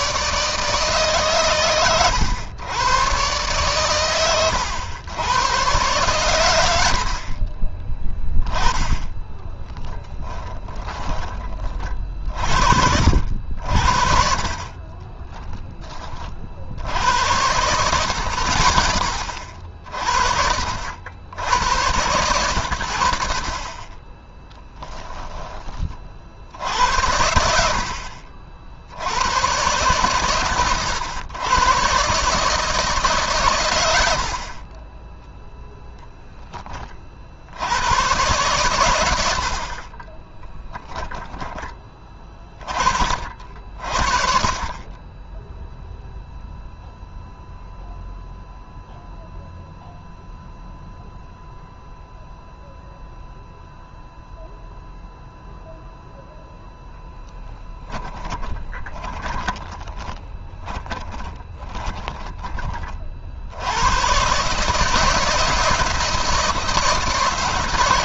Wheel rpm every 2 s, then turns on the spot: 140, 120, 100, 80, 20, 20, 60, 30, 80, 50, 70, 80, 10, 80, 70, 120, 150, 20, 30, 100, 10, 40, 20, 0, 0, 0, 0, 0, 10, 10, 20, 40, 150, 160.
40-42 58-62